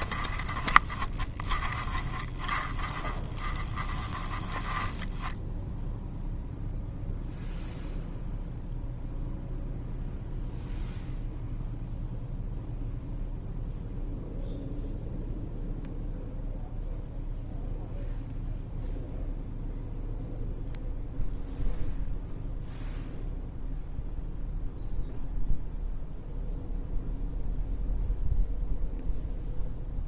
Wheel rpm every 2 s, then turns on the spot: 30, 30, 20, 0, 0, 0, 0, 0, 0, 0, 0, 0, 0, 0, 0.
0-6